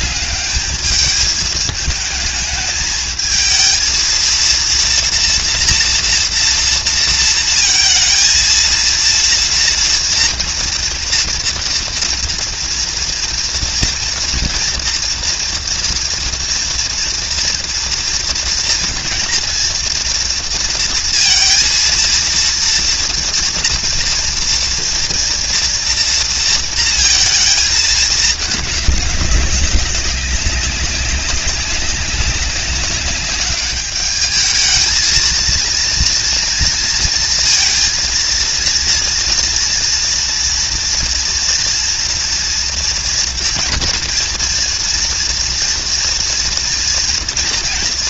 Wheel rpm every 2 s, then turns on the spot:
220, 230, 230, 220, 230, 230, 240, 230, 230, 240, 230, 230, 230, 210, 200, 200, 210, 230, 230, 240, 230, 230, 240, 230.
none